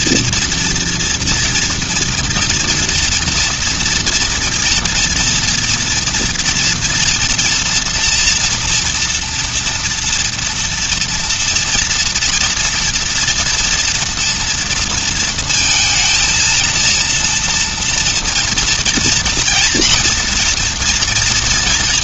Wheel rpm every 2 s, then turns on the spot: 230, 230, 230, 230, 230, 230, 230, 230, 230, 230, 240.
none